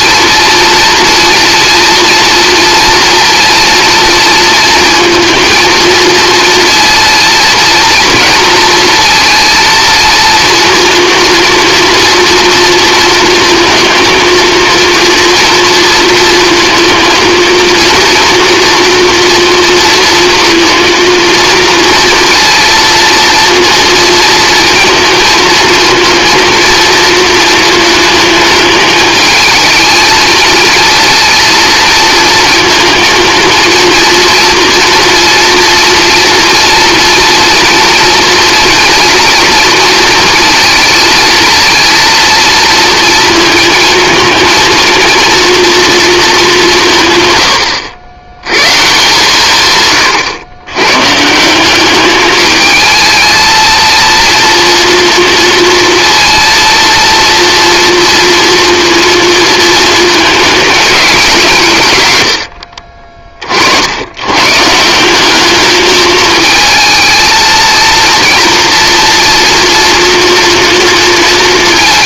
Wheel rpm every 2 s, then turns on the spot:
230, 230, 230, 230, 220, 230, 230, 230, 230, 230, 230, 230, 230, 230, 220, 230, 230, 230, 230, 230, 230, 230, 230, 180, 130, 110, 220, 230, 230, 230, 220, 60, 140, 220, 230, 230.
62-64